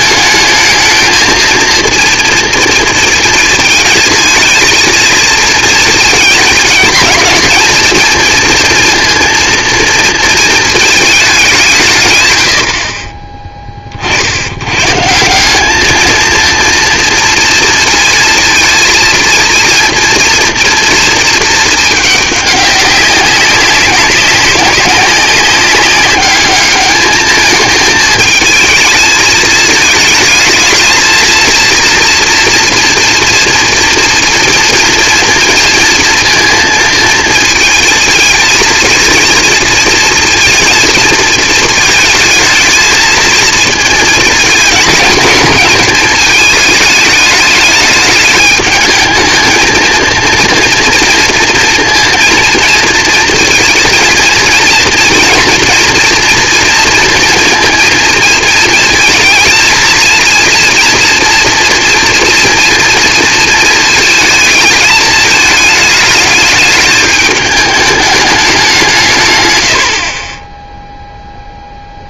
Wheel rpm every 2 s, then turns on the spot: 220, 230, 230, 210, 230, 220, 80, 110, 230, 230, 230, 200, 200, 210, 220, 220, 230, 230, 230, 230, 230, 220, 220, 210, 210, 230, 230, 230, 230, 230, 230, 240, 220, 210, 190, 40.
none